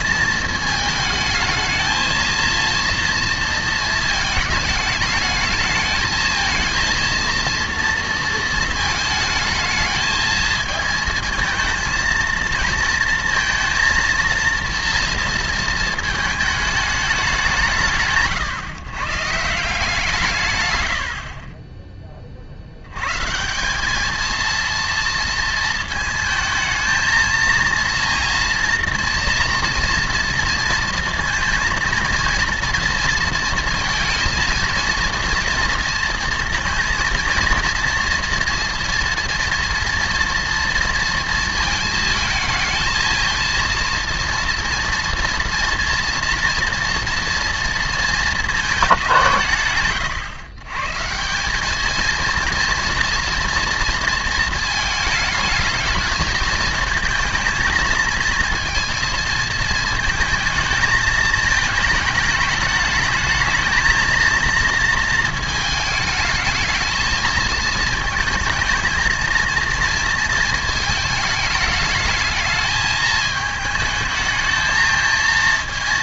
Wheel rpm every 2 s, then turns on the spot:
220, 230, 220, 220, 230, 220, 230, 230, 210, 140, 110, 60, 230, 220, 240, 230, 230, 230, 230, 230, 230, 220, 230, 240, 210, 120, 230, 220, 230, 230, 220, 220, 230, 220, 220, 220, 220, 220.
none